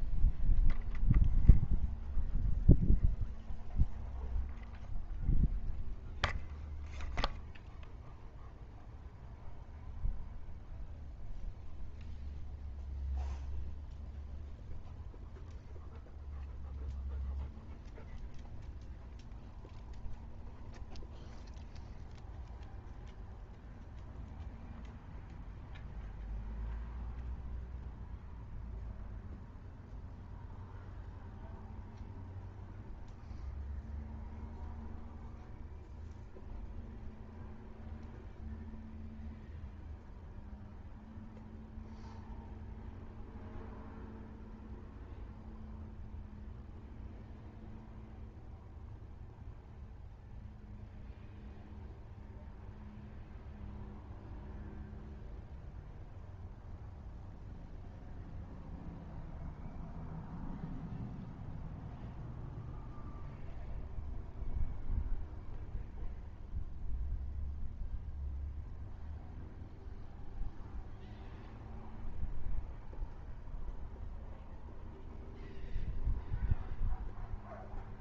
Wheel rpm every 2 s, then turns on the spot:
0, 0, 0, 0, 0, 0, 0, 0, 0, 0, 0, 0, 0, 0, 0, 0, 0, 0, 0, 0, 0, 0, 0, 0, 0, 0, 0, 0, 0, 0, 0, 0, 0, 0, 0, 0, 0, 0, 0.
none